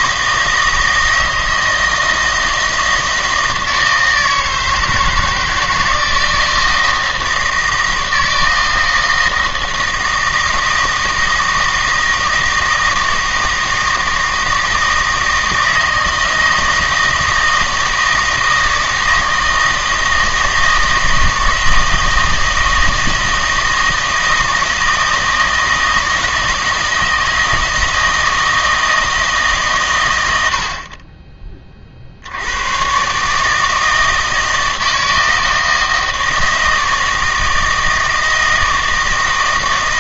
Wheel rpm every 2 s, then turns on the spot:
160, 160, 160, 160, 160, 160, 160, 160, 160, 160, 160, 160, 160, 160, 160, 80, 100, 160, 160, 160.
none